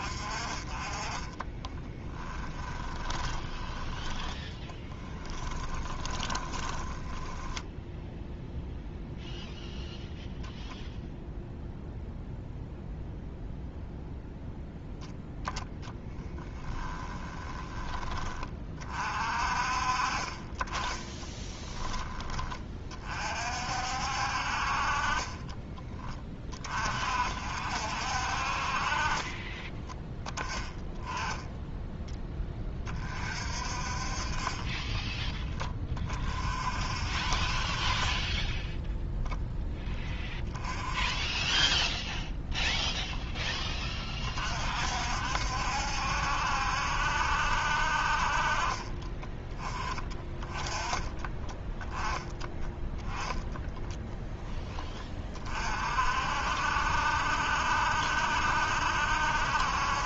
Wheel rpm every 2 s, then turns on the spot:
30, 10, 10, 20, 0, 0, 0, 0, 10, 30, 20, 30, 50, 40, 50, 10, 20, 20, 40, 10, 10, 0, 40, 70, 30, 20, 10, 10, 60, 70.
2-8 16-18 34-36